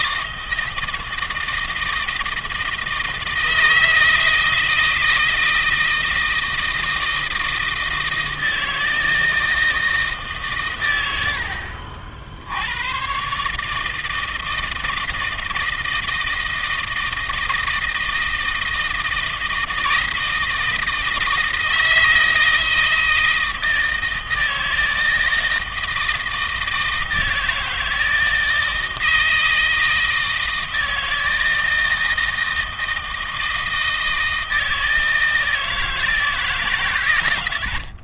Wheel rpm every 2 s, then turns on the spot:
160, 160, 160, 160, 160, 100, 120, 160, 160, 160, 160, 160, 160, 160, 160, 160, 160, 160, 120.
none